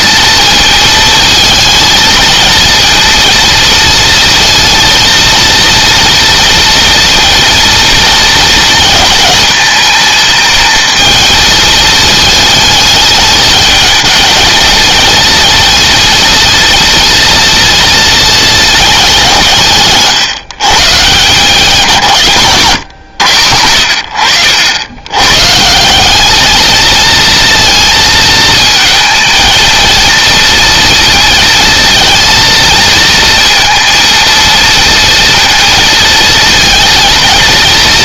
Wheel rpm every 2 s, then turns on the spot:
230, 230, 230, 230, 220, 220, 220, 230, 230, 220, 140, 120, 90, 220, 220, 230, 230, 230, 230.
none